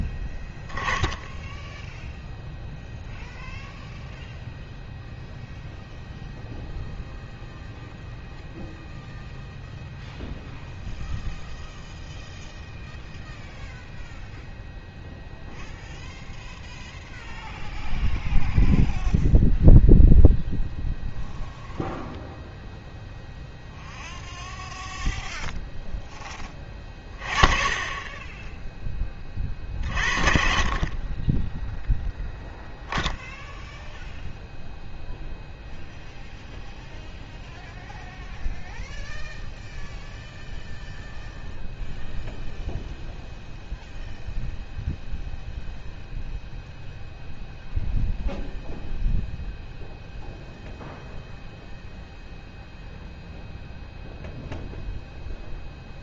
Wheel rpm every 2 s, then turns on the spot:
10, 0, 0, 0, 0, 0, 0, 0, 0, 0, 0, 0, 0, 20, 10, 40, 0, 0, 0, 0, 0, 0, 0, 0, 0, 0, 0, 0.
none